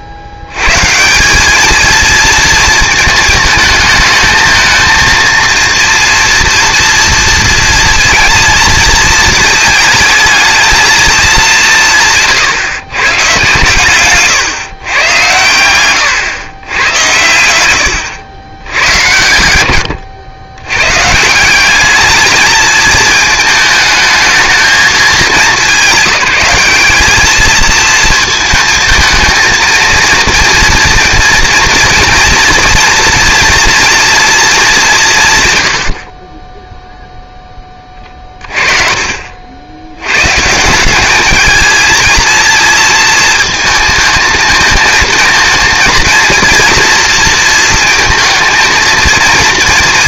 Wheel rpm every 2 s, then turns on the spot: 130, 230, 220, 230, 230, 220, 140, 120, 120, 90, 130, 210, 220, 210, 220, 230, 230, 200, 0, 40, 180, 230, 220, 230, 230.
none